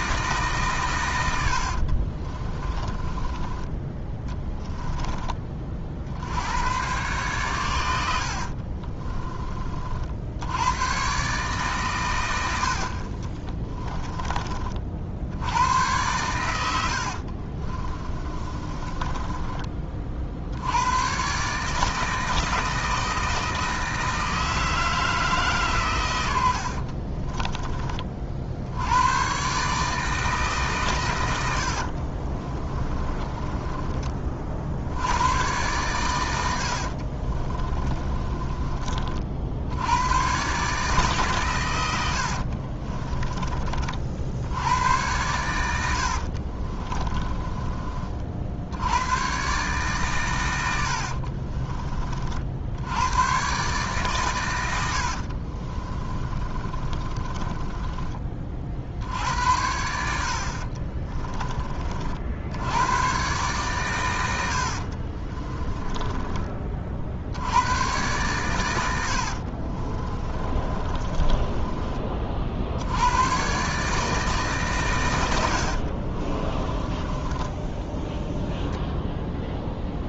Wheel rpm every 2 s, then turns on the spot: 140, 30, 10, 110, 40, 110, 70, 50, 70, 30, 90, 160, 160, 50, 80, 130, 20, 70, 60, 30, 140, 40, 90, 30, 90, 80, 80, 90, 30, 60, 40, 100, 60, 40, 100, 20, 70, 130, 20, 0.
2-6 8-10 16-20 26-28 32-34 36-38 42-44 46-48 50-52 56-58 60-62 64-66 70-72 76-78